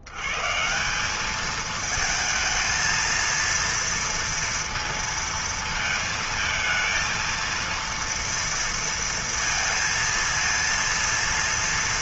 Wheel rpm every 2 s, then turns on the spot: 90, 220, 230, 220, 230, 230.
none